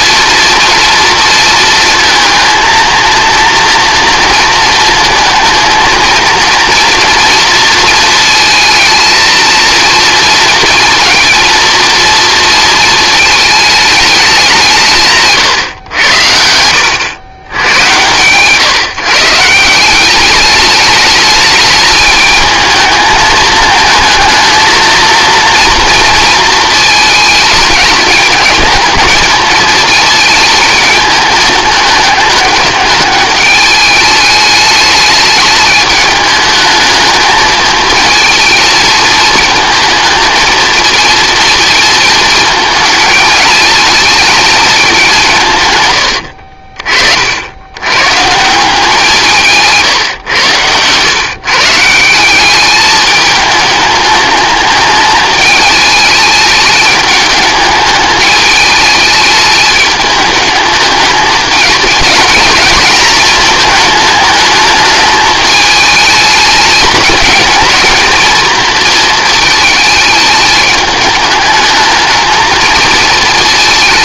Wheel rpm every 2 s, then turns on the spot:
230, 230, 230, 230, 220, 230, 230, 170, 80, 140, 210, 220, 230, 220, 220, 220, 210, 210, 220, 220, 220, 220, 210, 50, 180, 110, 200, 210, 210, 210, 210, 210, 210, 220, 230, 210, 220.
none